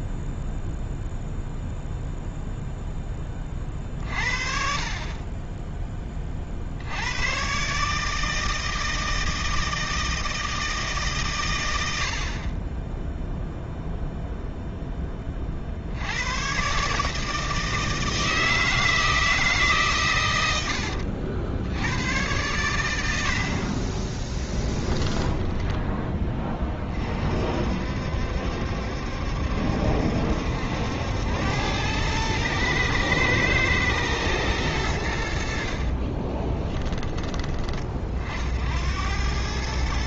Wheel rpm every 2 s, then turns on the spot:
0, 0, 50, 40, 160, 160, 40, 0, 120, 160, 100, 100, 10, 20, 70, 70, 110, 110, 20, 60.
20-22 24-26 36-38